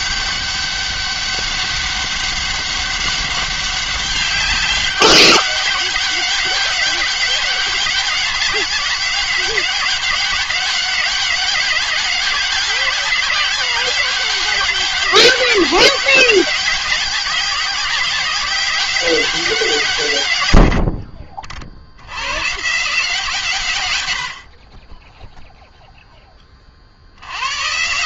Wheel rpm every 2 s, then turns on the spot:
200, 200, 200, 200, 200, 200, 190, 190, 190, 180, 100, 140, 60, 10.
none